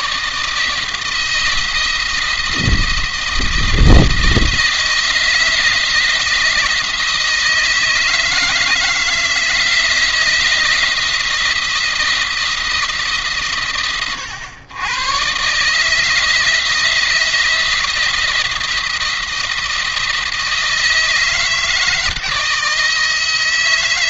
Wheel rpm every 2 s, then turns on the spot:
160, 160, 170, 160, 160, 170, 150, 110, 160, 170, 160, 160.
none